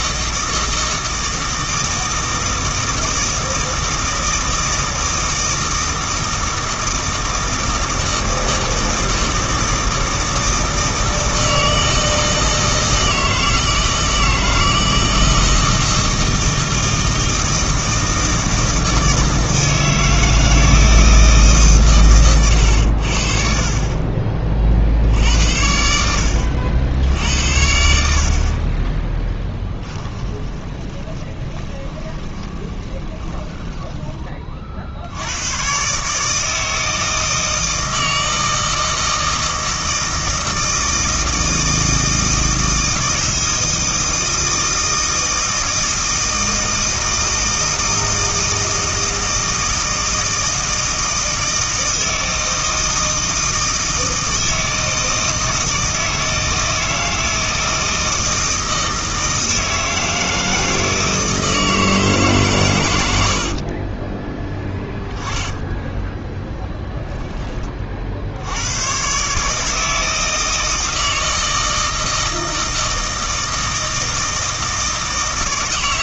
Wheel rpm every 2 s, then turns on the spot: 160, 160, 160, 160, 160, 160, 160, 160, 160, 160, 160, 100, 50, 80, 30, 20, 20, 40, 160, 160, 160, 160, 160, 160, 160, 160, 160, 160, 160, 160, 160, 110, 10, 10, 90, 160, 160, 160.
30-34 64-68